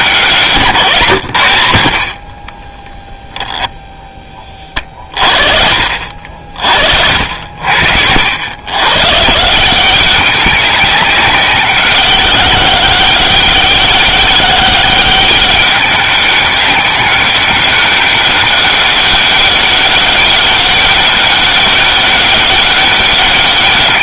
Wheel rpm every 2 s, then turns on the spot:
140, 10, 30, 60, 110, 190, 190, 200, 200, 200, 200, 200.
2-4